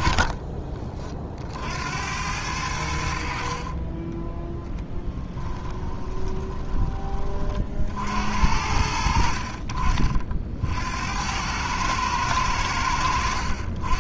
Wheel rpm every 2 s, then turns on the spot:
30, 80, 10, 20, 70, 60, 90.
4-8